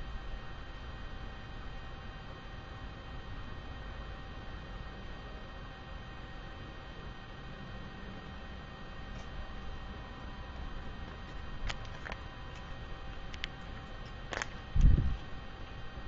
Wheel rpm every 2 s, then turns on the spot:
0, 0, 0, 0, 0, 0, 0, 0.
none